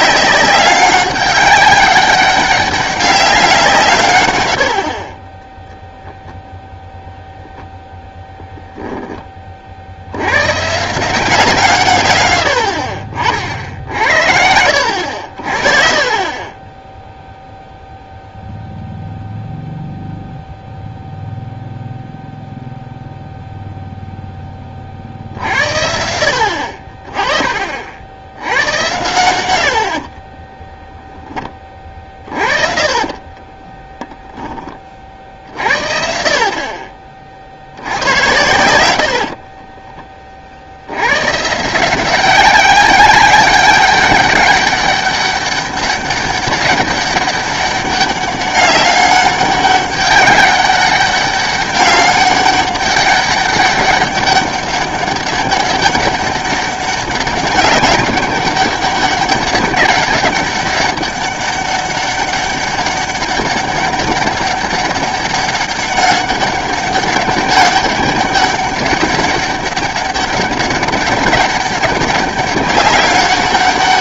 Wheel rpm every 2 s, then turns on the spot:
190, 200, 80, 0, 0, 120, 70, 80, 20, 0, 0, 0, 30, 50, 100, 10, 40, 30, 50, 100, 60, 190, 200, 200, 200, 200, 200, 200, 200, 200, 190, 200, 200, 200, 200, 200, 200.
4-6 30-34 38-40